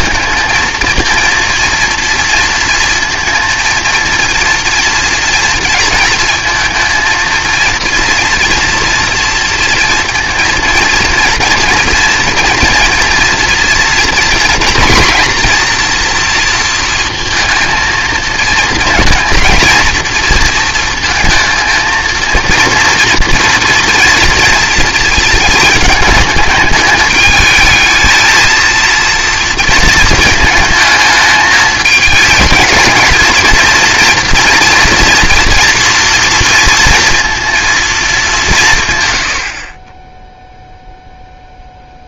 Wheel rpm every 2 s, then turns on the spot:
220, 230, 240, 220, 230, 230, 230, 220, 230, 230, 230, 230, 230, 210, 230, 220, 220, 230, 230, 170, 0.
none